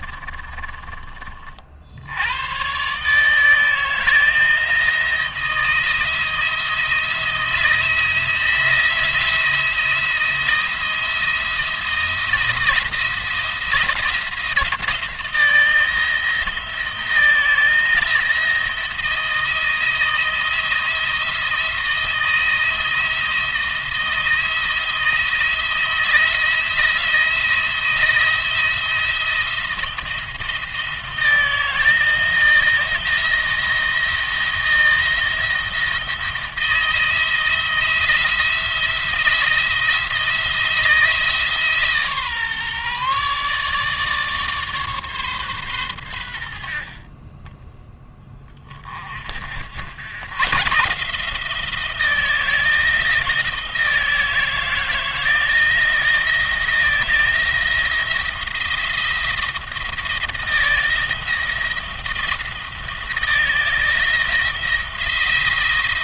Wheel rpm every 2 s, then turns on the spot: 30, 140, 160, 170, 170, 170, 170, 160, 160, 170, 170, 160, 160, 170, 170, 170, 160, 170, 170, 170, 160, 140, 140, 40, 30, 150, 160, 170, 160, 170, 170, 170, 170.
none